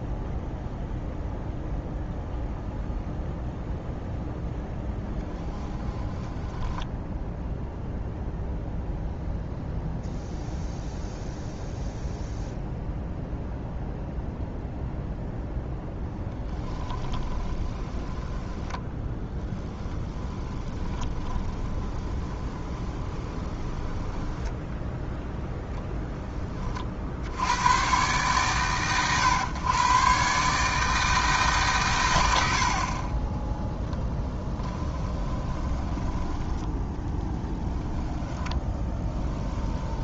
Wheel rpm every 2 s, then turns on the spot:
0, 0, 10, 10, 0, 0, 0, 0, 10, 10, 20, 20, 10, 30, 120, 150, 50, 10, 10, 10.
6-8 16-26 34-36 38-40